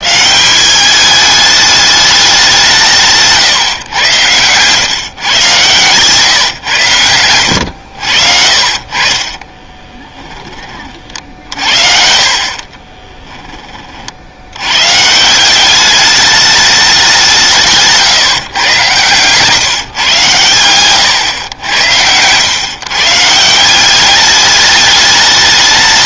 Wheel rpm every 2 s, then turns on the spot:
180, 190, 120, 130, 50, 40, 40, 100, 210, 130, 120, 120, 210.
12-14 20-22